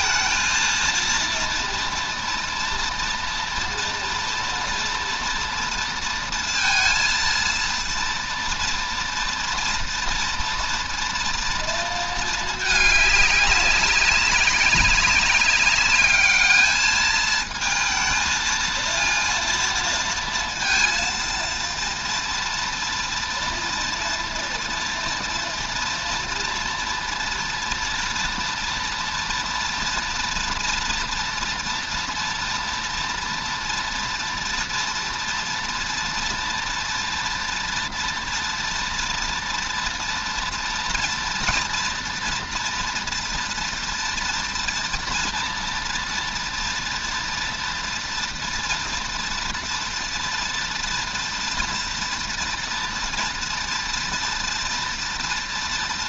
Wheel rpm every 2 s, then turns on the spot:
230, 230, 230, 230, 230, 230, 210, 200, 210, 230, 230, 230, 240, 230, 230, 240, 230, 240, 230, 230, 230, 240, 230, 230, 230, 230, 230, 230.
none